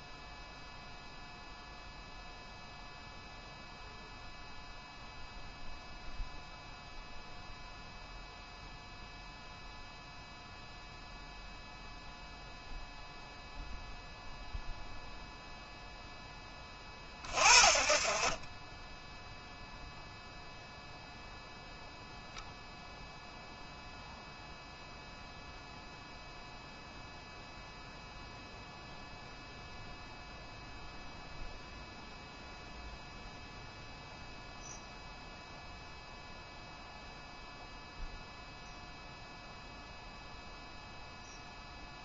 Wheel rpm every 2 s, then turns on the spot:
0, 0, 0, 0, 0, 0, 0, 0, 30, 10, 0, 0, 0, 0, 0, 0, 0, 0, 0, 0, 0.
none